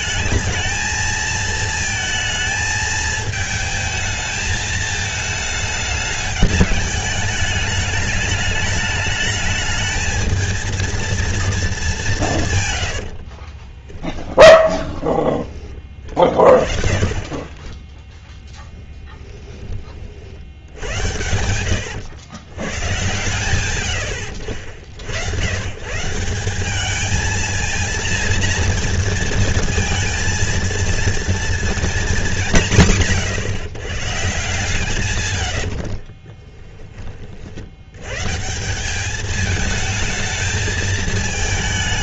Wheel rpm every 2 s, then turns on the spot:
220, 220, 220, 210, 210, 230, 110, 10, 20, 20, 70, 110, 70, 190, 230, 230, 180, 140, 20, 160, 220.
12-16 18-20